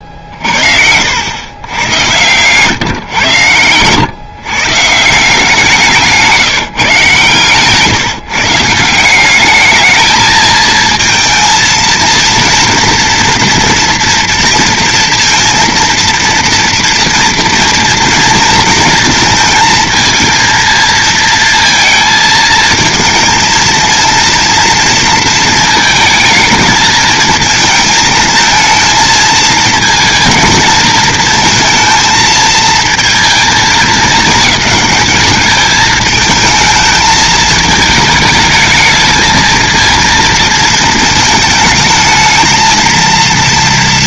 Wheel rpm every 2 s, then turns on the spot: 60, 130, 140, 160, 150, 220, 230, 230, 230, 230, 220, 220, 230, 220, 230, 220, 220, 200, 220, 220, 230, 220.
none